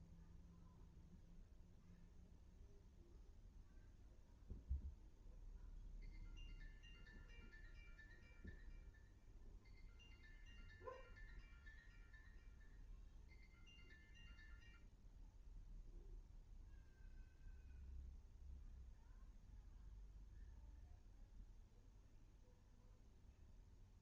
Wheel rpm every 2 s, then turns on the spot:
0, 0, 0, 0, 0, 0, 0, 0, 0, 0, 0, 0.
none